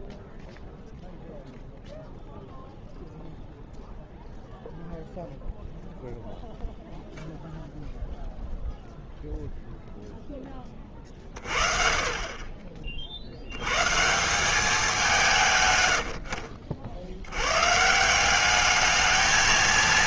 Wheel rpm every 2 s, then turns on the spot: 0, 0, 0, 0, 10, 40, 190, 60, 190, 230.
none